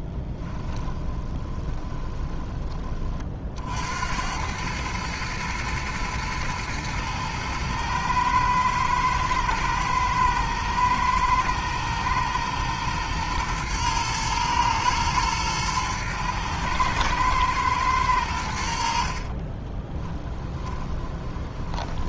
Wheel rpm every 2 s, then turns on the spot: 20, 30, 110, 110, 110, 110, 110, 110, 110, 60, 20.
0-2 20-22